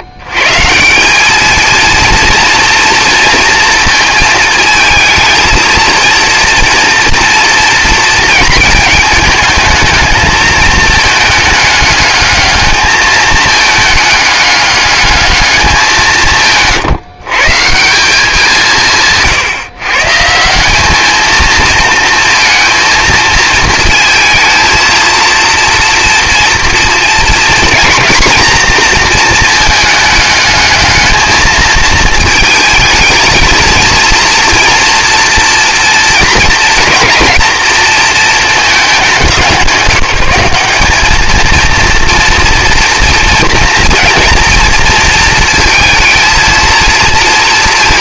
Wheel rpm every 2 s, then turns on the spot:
110, 230, 220, 230, 220, 220, 220, 210, 140, 170, 190, 230, 220, 230, 230, 210, 220, 230, 220, 230, 190, 230, 230, 230.
none